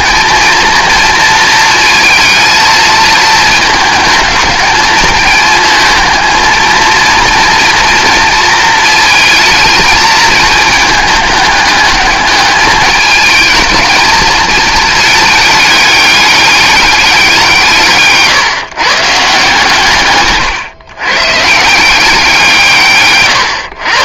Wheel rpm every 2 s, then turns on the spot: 230, 220, 210, 220, 220, 220, 210, 230, 200, 140, 130, 160.
none